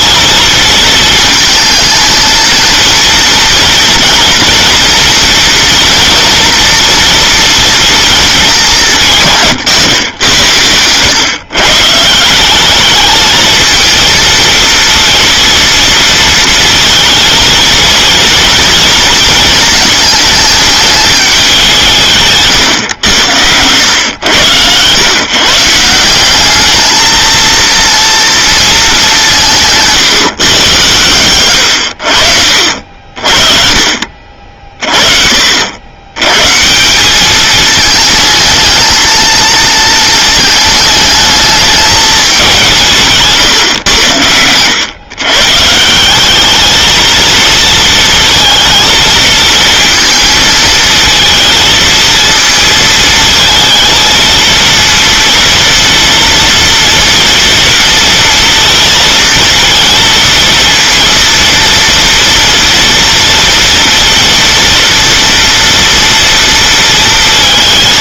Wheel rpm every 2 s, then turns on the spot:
220, 220, 230, 230, 190, 110, 190, 230, 230, 230, 210, 120, 110, 210, 230, 130, 60, 50, 160, 220, 220, 180, 110, 220, 230, 220, 220, 230, 230, 230, 230, 240, 240, 230.
none